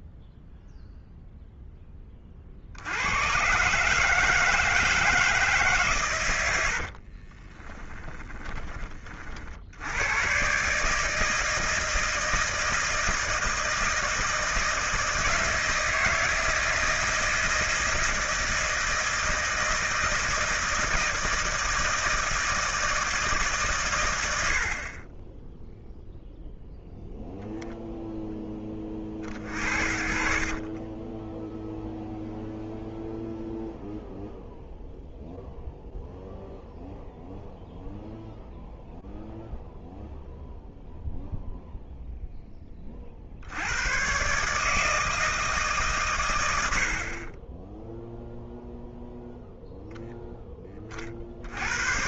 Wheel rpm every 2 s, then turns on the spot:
0, 80, 160, 60, 30, 150, 160, 160, 160, 160, 160, 160, 40, 0, 20, 20, 0, 0, 0, 0, 0, 30, 160, 80, 0, 30.
6-8 30-32 46-48